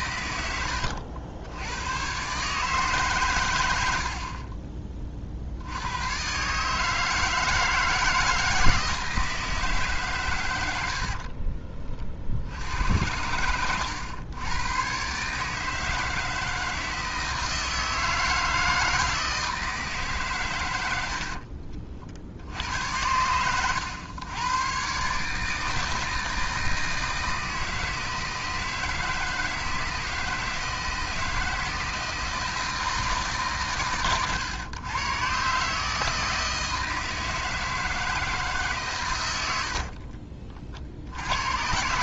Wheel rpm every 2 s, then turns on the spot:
80, 140, 20, 140, 160, 100, 80, 110, 160, 160, 110, 70, 120, 160, 160, 160, 160, 120, 160, 150, 40.
0-2